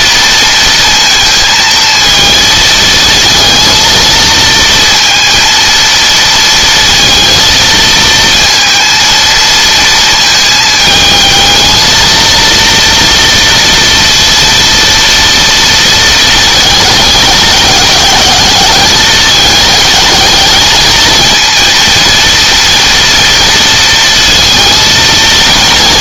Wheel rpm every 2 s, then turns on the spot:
230, 230, 230, 230, 230, 220, 230, 230, 210, 220, 220, 230, 220.
none